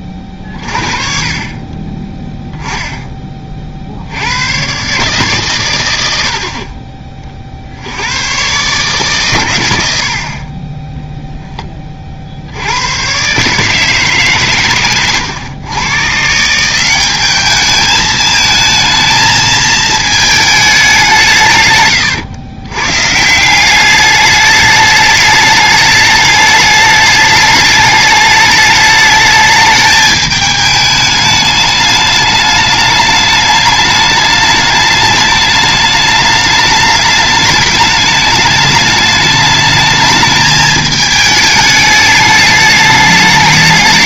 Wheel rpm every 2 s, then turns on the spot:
30, 10, 130, 40, 130, 20, 90, 130, 180, 220, 200, 120, 210, 210, 210, 210, 210, 210, 210, 210, 220, 210.
none